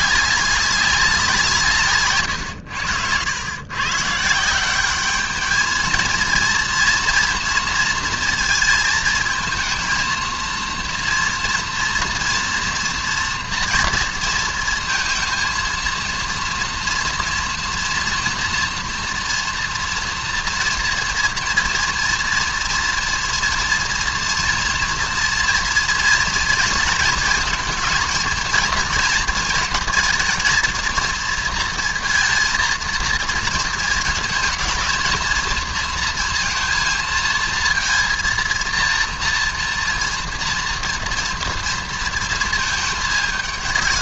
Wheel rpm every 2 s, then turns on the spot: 200, 100, 180, 230, 220, 230, 230, 230, 230, 230, 230, 230, 230, 230, 230, 230, 230, 230, 230, 230, 230, 220.
2-4